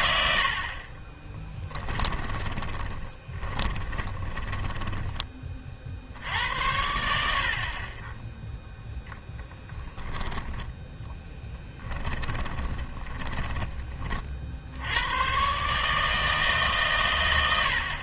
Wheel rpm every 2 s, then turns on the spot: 30, 20, 10, 70, 0, 10, 20, 90, 140.
0-6 12-14